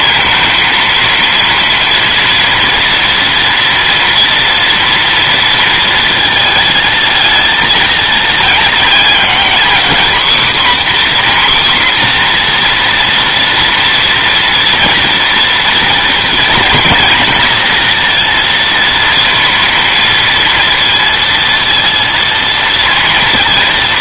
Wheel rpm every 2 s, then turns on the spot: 230, 230, 230, 220, 230, 260, 240, 240, 230, 230, 230, 230.
none